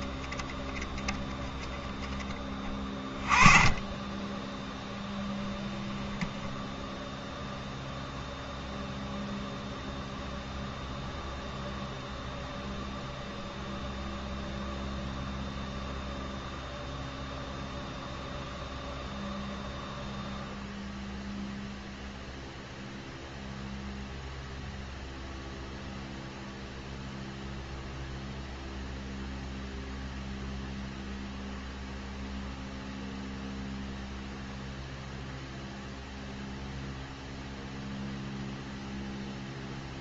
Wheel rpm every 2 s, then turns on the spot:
20, 30, 10, 0, 0, 0, 0, 0, 0, 0, 0, 0, 0, 0, 0, 0, 0, 0, 0, 0.
none